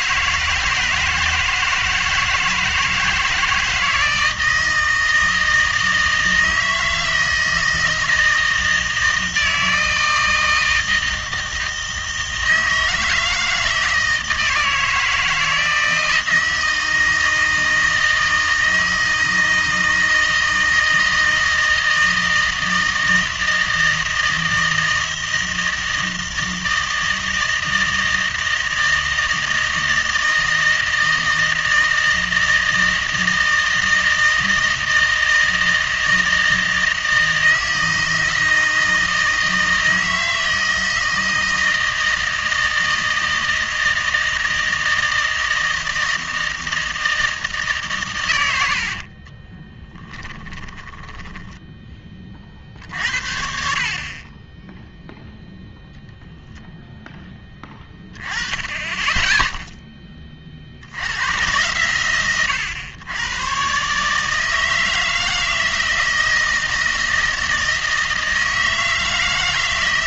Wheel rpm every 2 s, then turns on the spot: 160, 160, 160, 160, 160, 160, 160, 160, 160, 160, 160, 160, 160, 160, 160, 160, 160, 160, 160, 160, 160, 160, 160, 160, 80, 10, 50, 10, 0, 20, 50, 110, 160, 160, 160.
50-52